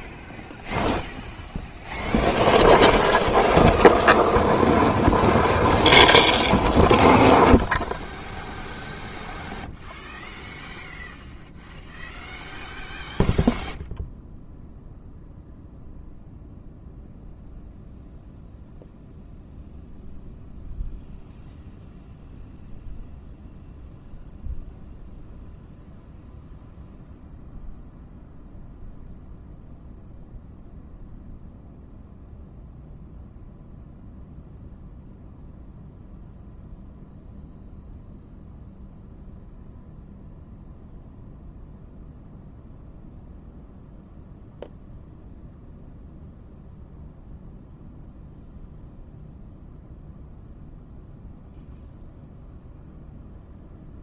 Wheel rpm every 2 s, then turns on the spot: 0, 0, 0, 0, 0, 0, 0, 0, 0, 0, 0, 0, 0, 0, 0, 0, 0, 0, 0, 0, 0, 0, 0, 0, 0, 0, 0.
none